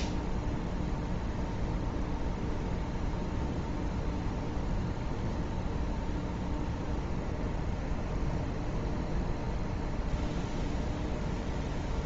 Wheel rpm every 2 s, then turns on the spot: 0, 0, 0, 0, 0, 0.
none